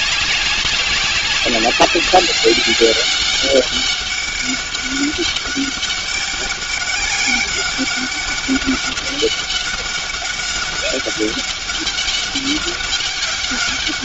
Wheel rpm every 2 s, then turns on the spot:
190, 200, 200, 200, 200, 200, 200.
none